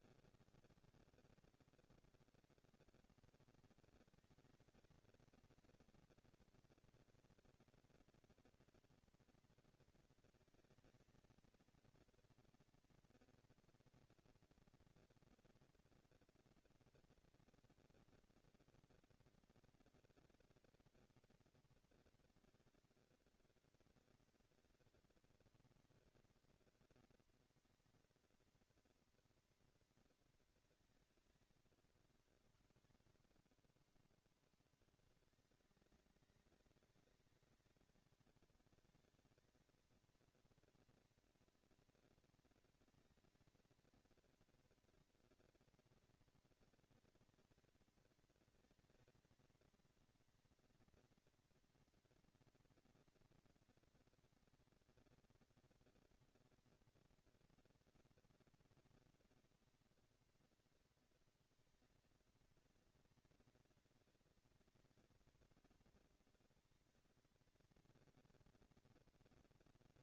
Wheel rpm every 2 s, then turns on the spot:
210, 230, 220, 240, 240, 230, 230, 230, 230, 230, 230, 230, 230, 230, 230, 220, 130, 150, 190, 200, 230, 230, 240, 230, 230, 230, 230, 230, 230, 230, 230, 230, 230, 230, 230.
none